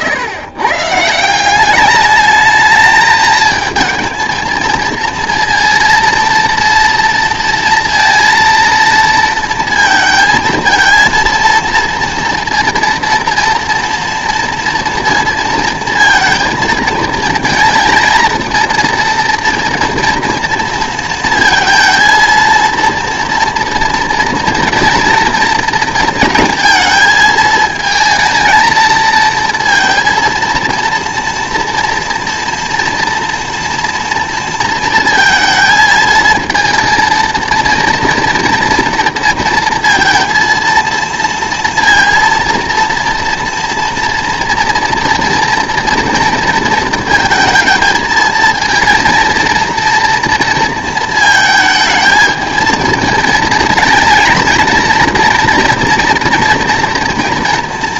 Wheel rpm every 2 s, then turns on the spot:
140, 220, 230, 230, 230, 230, 230, 240, 230, 230, 230, 220, 230, 220, 220, 230, 230, 230, 220, 230, 230, 230, 230, 230, 220, 230, 220, 230, 230.
none